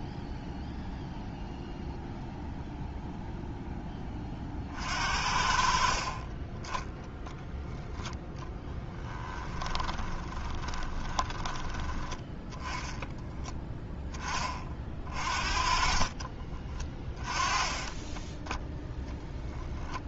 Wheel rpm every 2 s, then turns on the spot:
0, 0, 40, 20, 10, 20, 10, 30, 20, 10.
8-12 16-18